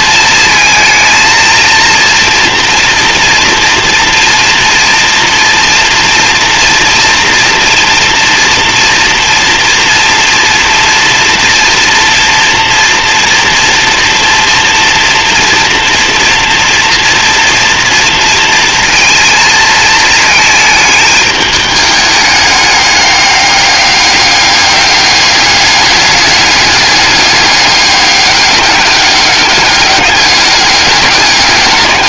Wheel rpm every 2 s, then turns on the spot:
230, 230, 230, 230, 230, 240, 230, 230, 230, 230, 220, 200, 200, 200, 200, 200.
none